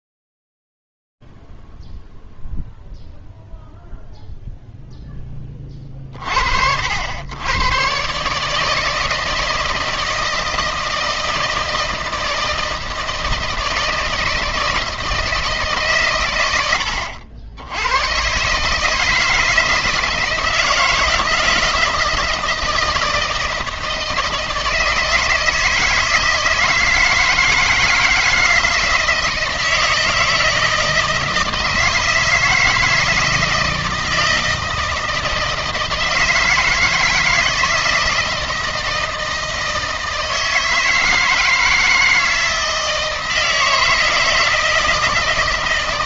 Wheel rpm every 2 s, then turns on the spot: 0, 0, 0, 30, 120, 160, 160, 160, 140, 110, 160, 160, 160, 160, 160, 160, 160, 160, 160, 160, 160, 160, 160.
none